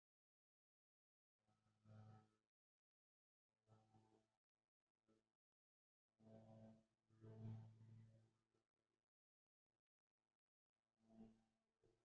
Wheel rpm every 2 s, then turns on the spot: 0, 0, 0, 0, 0, 0.
none